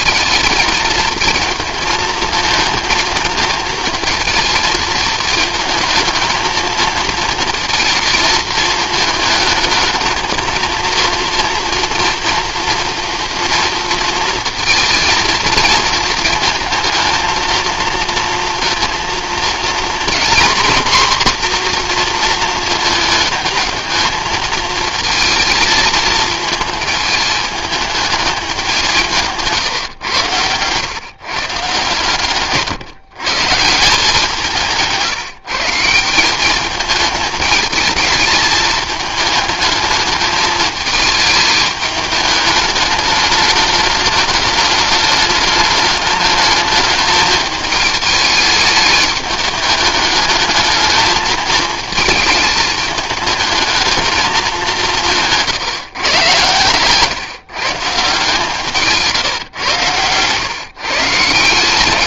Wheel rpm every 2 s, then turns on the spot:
220, 220, 220, 220, 220, 230, 230, 220, 220, 230, 250, 230, 220, 220, 190, 110, 150, 180, 200, 210, 220, 210, 210, 220, 210, 210, 220, 200, 130, 170, 140.
none